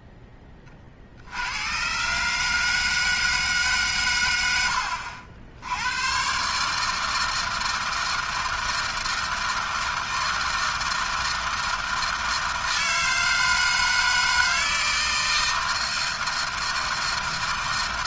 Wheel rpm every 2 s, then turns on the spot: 40, 160, 70, 150, 160, 160, 160, 160, 160.
none